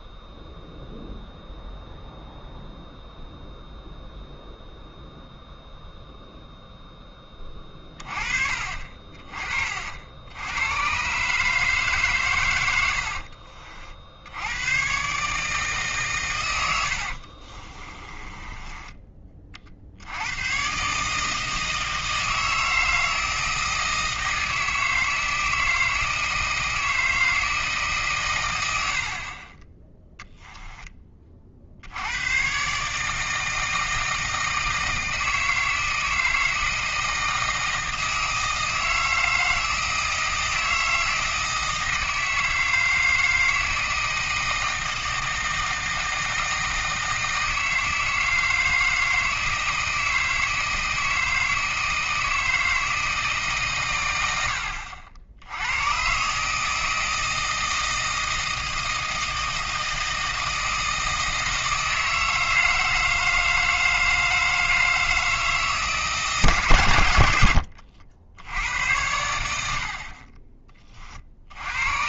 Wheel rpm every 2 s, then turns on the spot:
0, 0, 0, 10, 40, 120, 80, 120, 80, 20, 130, 160, 160, 160, 80, 10, 140, 160, 160, 160, 160, 160, 160, 160, 160, 160, 160, 60, 160, 160, 160, 160, 160, 120, 90, 20.
12-14 16-20